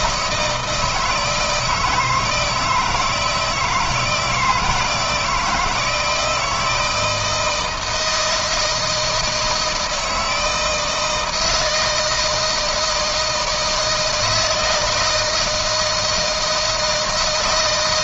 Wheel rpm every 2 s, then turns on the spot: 160, 160, 160, 170, 160, 160, 160, 160, 160.
none